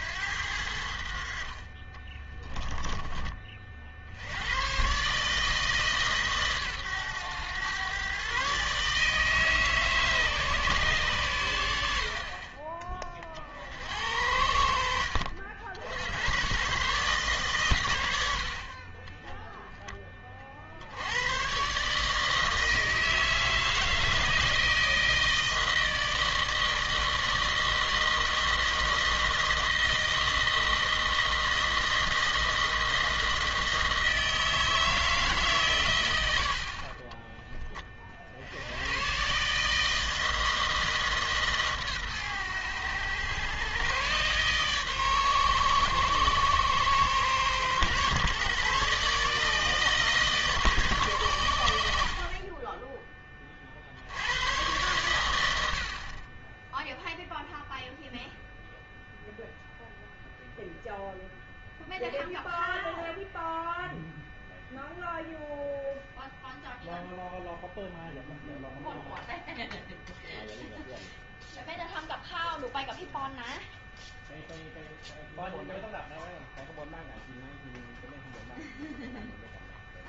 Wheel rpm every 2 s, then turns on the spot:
90, 10, 100, 130, 130, 140, 30, 70, 120, 60, 40, 160, 160, 160, 160, 160, 160, 160, 70, 70, 160, 110, 130, 120, 140, 150, 20, 100, 20, 0, 0, 0, 0, 0, 0, 0, 0, 0, 0, 0.
2-4